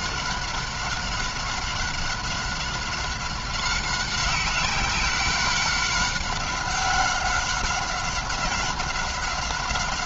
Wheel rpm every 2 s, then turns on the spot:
190, 190, 190, 190, 190.
none